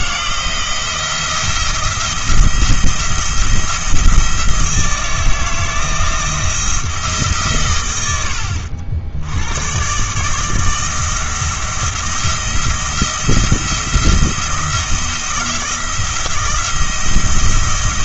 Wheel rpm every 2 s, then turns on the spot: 170, 170, 160, 170, 70, 160, 170, 170, 170.
none